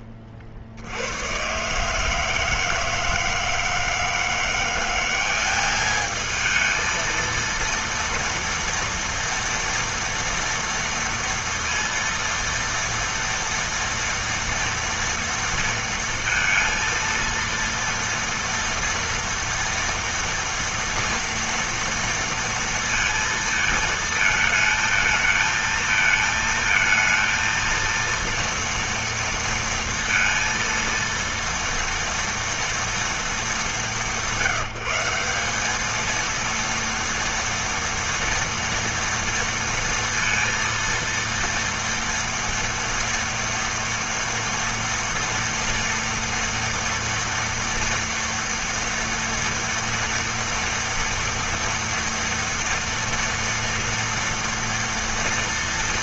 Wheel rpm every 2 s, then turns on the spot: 60, 160, 190, 230, 230, 230, 230, 230, 230, 230, 230, 230, 220, 230, 230, 230, 210, 180, 230, 230, 230, 230, 230, 230, 230, 230, 230, 230.
none